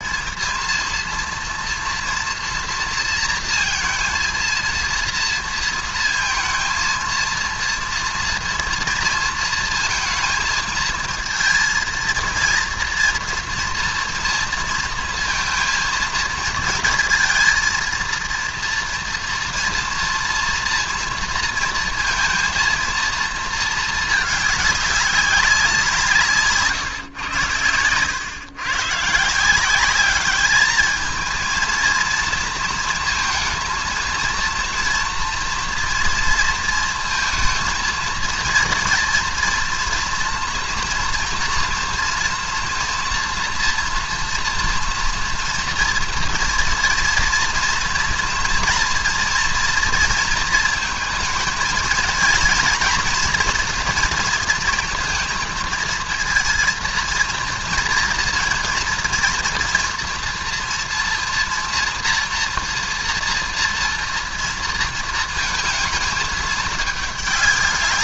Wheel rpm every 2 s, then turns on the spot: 220, 230, 230, 230, 230, 230, 230, 230, 230, 230, 230, 220, 220, 170, 110, 200, 230, 230, 230, 230, 240, 230, 230, 230, 230, 230, 230, 230, 230, 230, 240, 230, 230, 220.
none